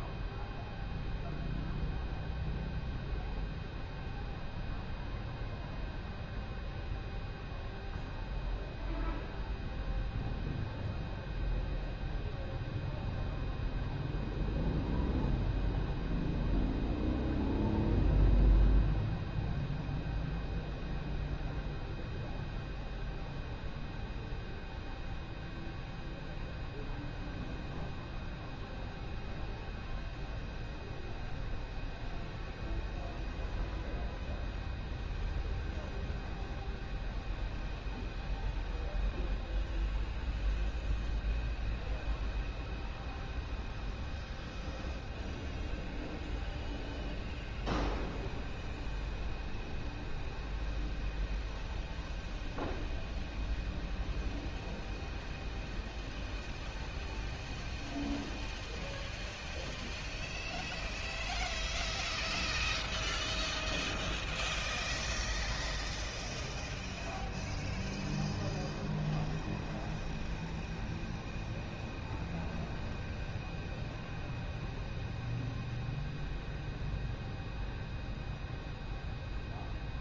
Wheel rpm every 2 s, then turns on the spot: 0, 0, 0, 0, 0, 0, 0, 0, 0, 0, 0, 0, 0, 0, 0, 0, 0, 0, 0, 0, 0, 0, 0, 0, 0, 0, 0, 0, 0, 0, 0, 0, 0, 0, 0, 0, 0, 0, 0, 0.
none